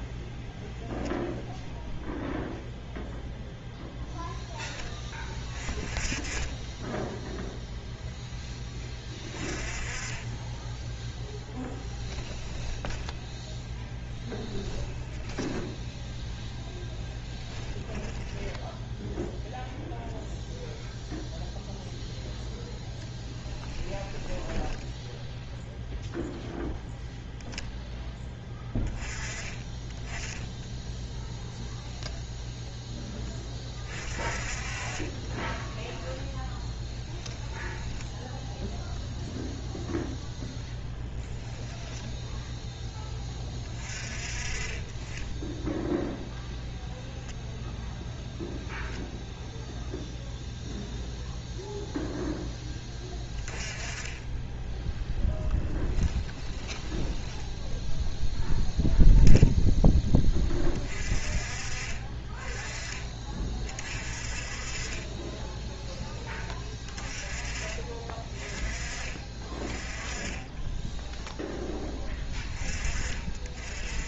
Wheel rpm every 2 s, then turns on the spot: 0, 0, 20, 10, 10, 10, 20, 10, 10, 10, 0, 0, 10, 0, 10, 0, 0, 30, 10, 0, 10, 10, 20, 0, 0, 0, 10, 10, 10, 0, 20, 30, 30, 20, 30, 10, 20.
12-16 24-26 36-38 56-58 70-72